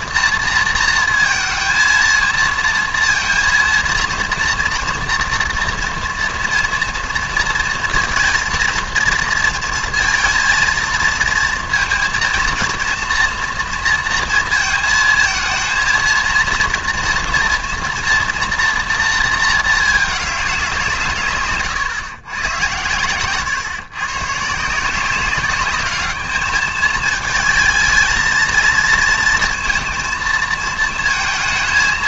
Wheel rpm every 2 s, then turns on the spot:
230, 230, 230, 230, 230, 230, 230, 230, 230, 240, 190, 110, 150, 210, 220, 230.
none